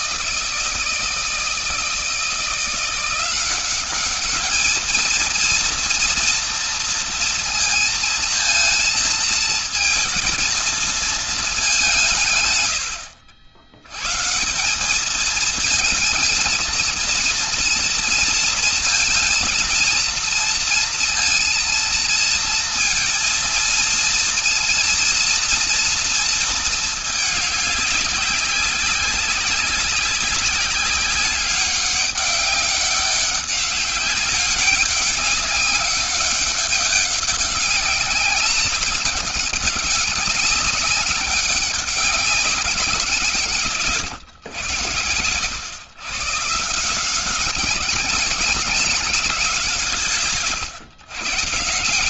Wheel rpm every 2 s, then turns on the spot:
160, 170, 210, 230, 230, 230, 120, 160, 230, 230, 230, 230, 230, 230, 200, 190, 200, 200, 200, 190, 200, 190, 120, 150, 190, 140.
none